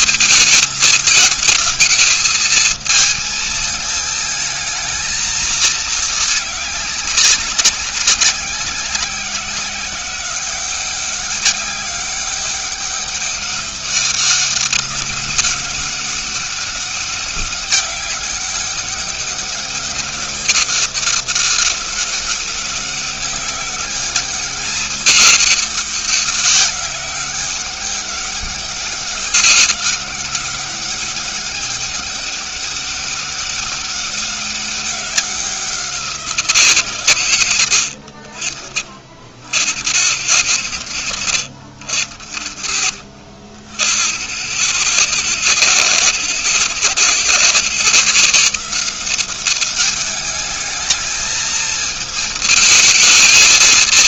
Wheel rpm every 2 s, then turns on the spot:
220, 220, 220, 210, 190, 190, 200, 200, 200, 190, 200, 200, 210, 190, 200, 200, 200, 200, 160, 50, 90, 60, 100, 120, 160, 210, 220.
none